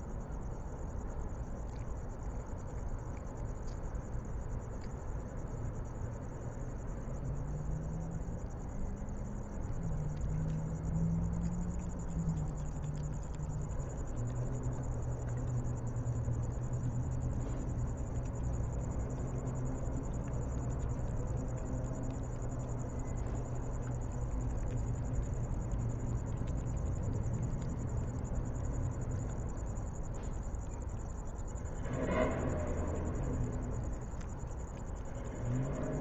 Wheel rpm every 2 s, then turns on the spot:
0, 0, 0, 0, 0, 0, 0, 0, 0, 0, 0, 0, 0, 0, 0, 0, 0, 0.
none